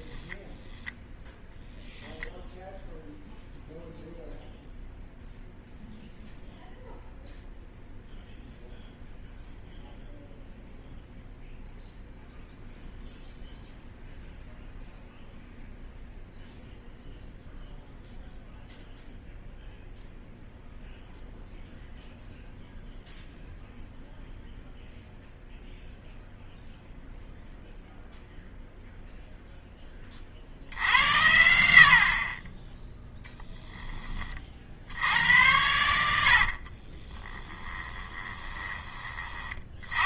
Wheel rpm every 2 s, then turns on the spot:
0, 0, 0, 0, 0, 0, 0, 0, 0, 0, 0, 0, 0, 0, 0, 70, 10, 60, 30, 20.
32-34 36-38